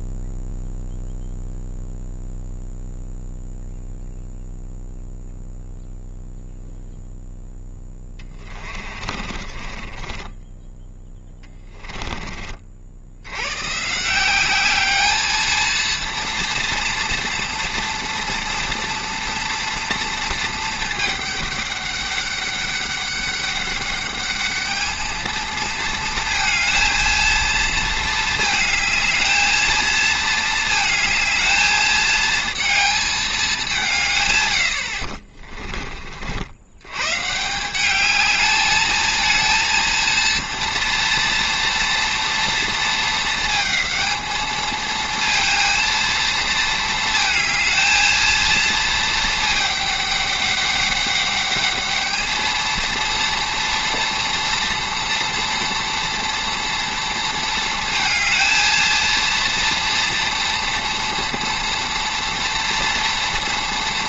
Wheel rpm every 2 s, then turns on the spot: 0, 0, 0, 0, 30, 10, 40, 200, 230, 230, 220, 200, 210, 220, 220, 220, 220, 100, 80, 210, 230, 230, 220, 220, 230, 200, 220, 240, 230, 220, 240, 230.
8-12 34-36